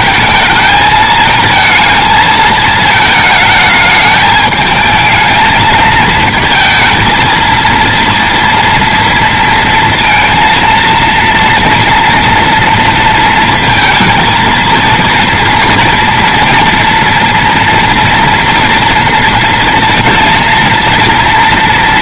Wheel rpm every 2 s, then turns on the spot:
220, 220, 220, 230, 230, 230, 230, 230, 240, 230, 230.
none